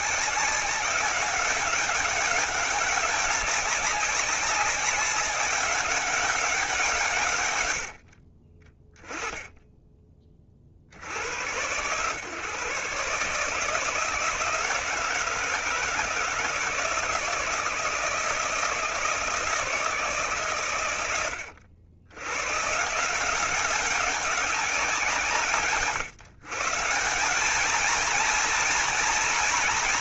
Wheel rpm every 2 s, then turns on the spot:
190, 200, 190, 180, 20, 50, 140, 160, 160, 160, 120, 150, 180, 160, 230.
none